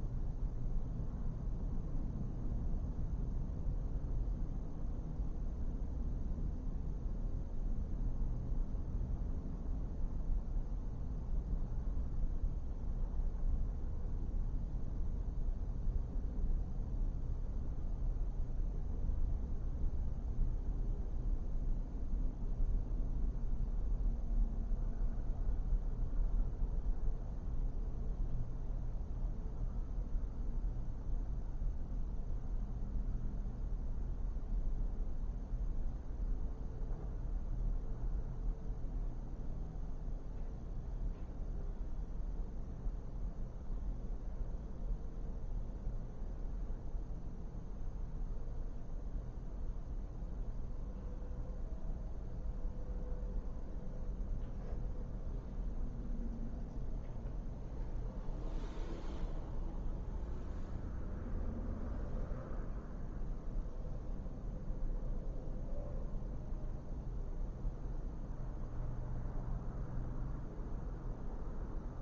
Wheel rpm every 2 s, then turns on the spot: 0, 0, 0, 0, 0, 0, 0, 0, 0, 0, 0, 0, 0, 0, 0, 0, 0, 0, 0, 0, 0, 0, 0, 0, 0, 0, 0, 0, 0, 0, 0, 0, 0, 0, 0, 0.
none